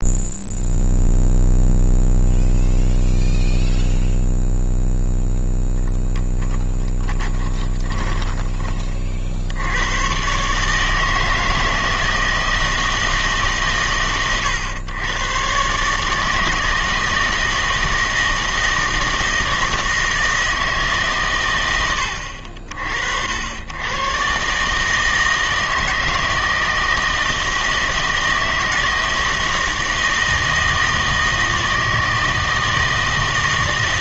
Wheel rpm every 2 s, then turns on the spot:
0, 0, 0, 20, 30, 140, 160, 110, 160, 160, 160, 60, 140, 160, 170, 160, 160.
6-8